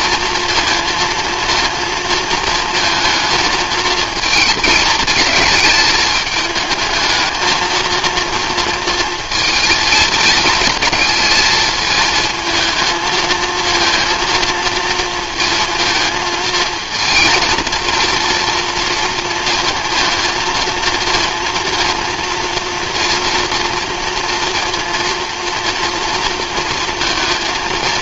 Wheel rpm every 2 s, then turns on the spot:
230, 220, 220, 210, 230, 220, 220, 230, 230, 230, 230, 230, 230, 230.
none